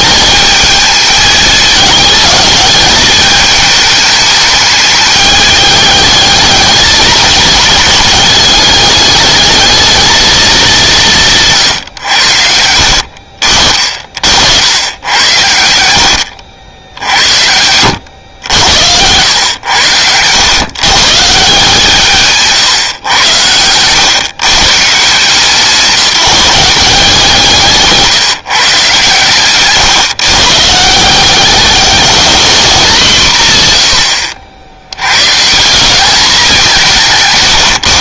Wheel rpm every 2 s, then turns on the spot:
220, 210, 210, 220, 210, 200, 70, 100, 80, 90, 130, 130, 140, 190, 150, 160, 210, 80, 190.
12-14